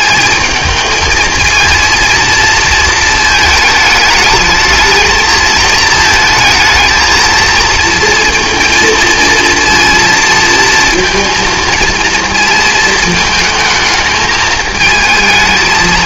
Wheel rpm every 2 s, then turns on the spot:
220, 220, 220, 220, 230, 230, 220, 220.
none